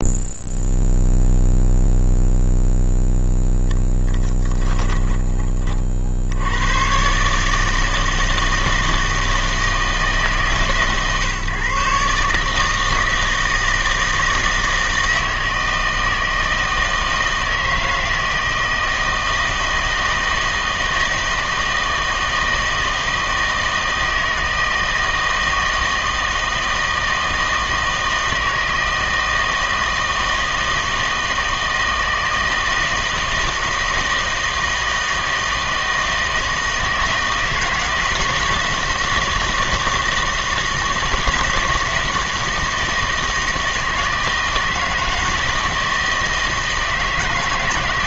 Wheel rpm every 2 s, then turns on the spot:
0, 0, 10, 110, 160, 150, 150, 160, 160, 160, 160, 160, 160, 160, 160, 160, 160, 160, 160, 160, 160, 170, 160, 160.
none